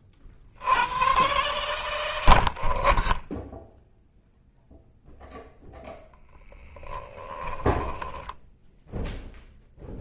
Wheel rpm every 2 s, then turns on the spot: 70, 40, 0, 0, 0.
none